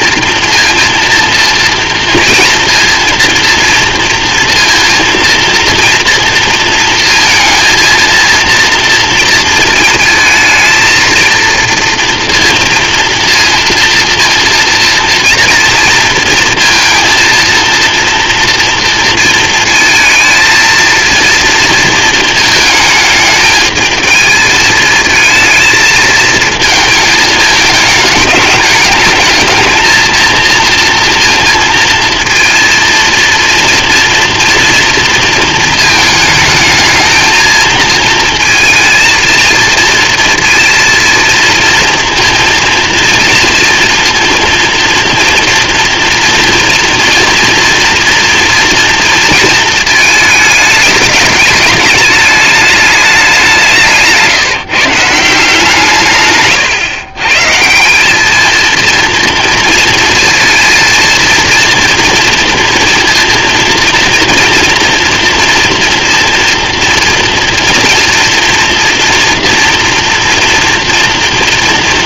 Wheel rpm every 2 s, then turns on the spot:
230, 230, 230, 230, 230, 230, 230, 230, 230, 230, 230, 220, 220, 220, 210, 230, 230, 230, 220, 230, 230, 230, 230, 230, 230, 210, 200, 160, 130, 230, 230, 230, 230, 230, 240, 230.
none